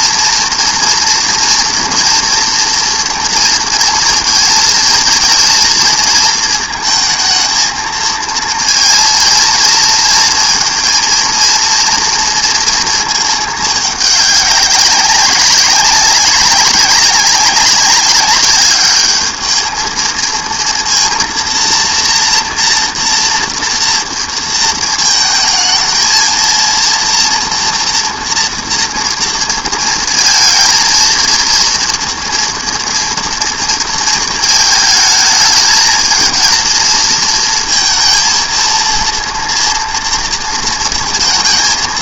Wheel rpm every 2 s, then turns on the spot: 230, 240, 220, 220, 230, 230, 230, 200, 200, 200, 230, 230, 230, 230, 230, 230, 230, 220, 230, 230, 230.
none